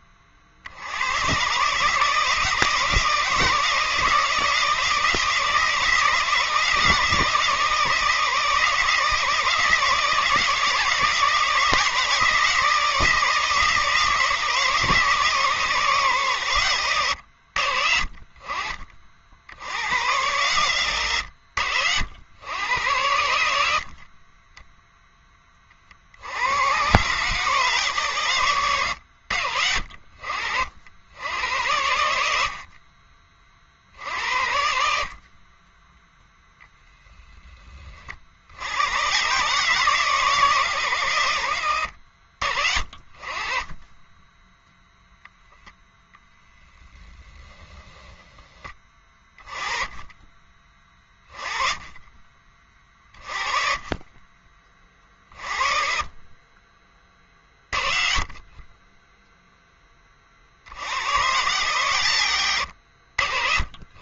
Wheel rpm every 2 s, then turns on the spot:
70, 160, 160, 160, 160, 160, 160, 160, 120, 40, 120, 100, 10, 100, 100, 60, 50, 70, 0, 80, 130, 50, 0, 10, 20, 20, 30, 30, 30, 30, 60, 90.
none